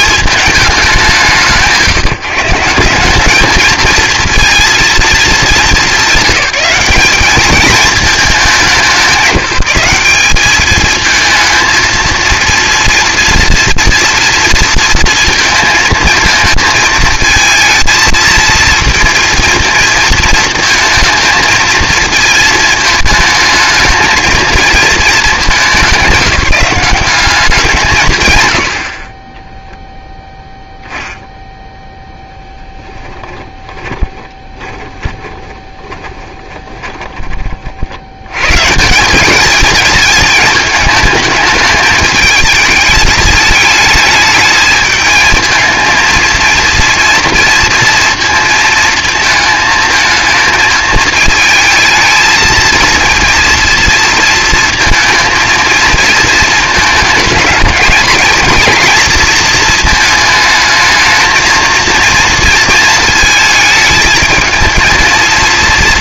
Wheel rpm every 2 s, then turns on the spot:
200, 170, 230, 200, 190, 220, 230, 230, 220, 220, 220, 220, 230, 200, 90, 0, 10, 20, 20, 160, 220, 210, 220, 230, 230, 220, 230, 230, 220, 230, 220, 230, 220.
32-38